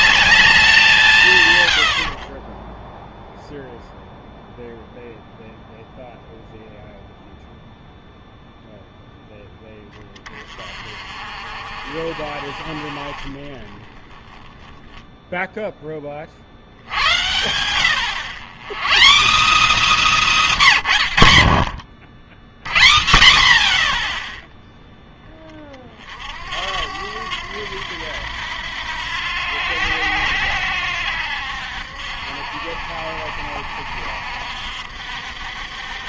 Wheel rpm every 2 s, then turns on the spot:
190, 10, 0, 0, 0, 30, 40, 10, 70, 150, 230, 100, 0, 80, 80, 80, 70, 60.
none